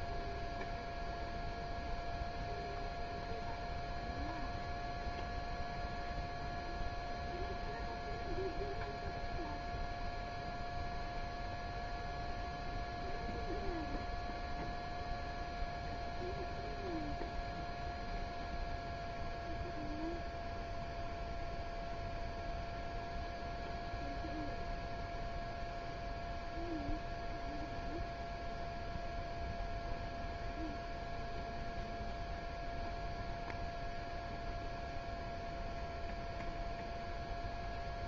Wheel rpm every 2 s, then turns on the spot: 0, 0, 0, 0, 0, 0, 0, 0, 0, 0, 0, 0, 0, 0, 0, 0, 0, 0, 0.
none